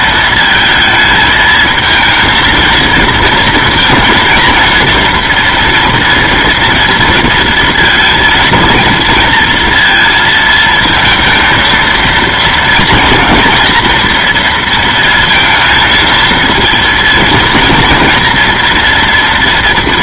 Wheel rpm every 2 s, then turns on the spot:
220, 230, 230, 230, 230, 220, 230, 230, 230, 230.
none